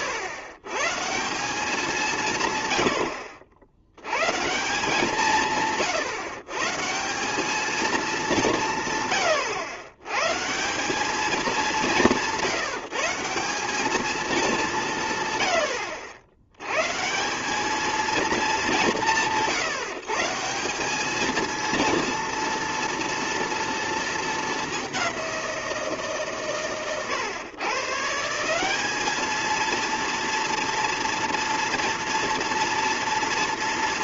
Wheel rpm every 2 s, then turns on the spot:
130, 110, 160, 150, 170, 160, 170, 190, 120, 200, 180, 230, 200, 140, 200, 230, 230.
none